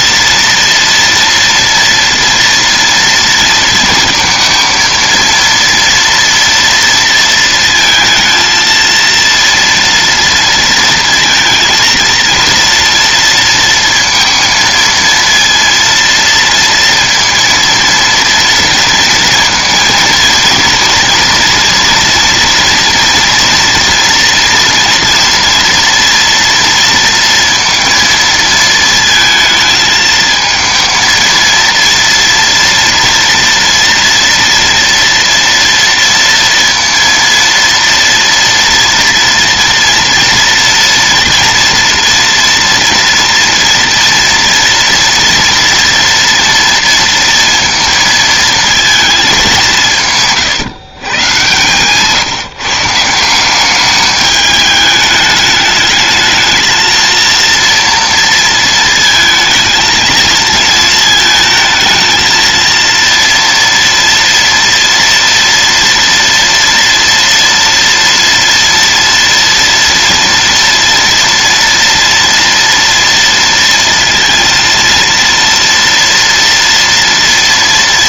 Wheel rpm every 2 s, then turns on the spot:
230, 230, 230, 230, 230, 230, 230, 230, 230, 230, 230, 240, 240, 230, 230, 220, 230, 230, 230, 230, 230, 230, 240, 230, 230, 140, 160, 210, 220, 230, 220, 230, 230, 230, 230, 230, 230, 230, 230.
none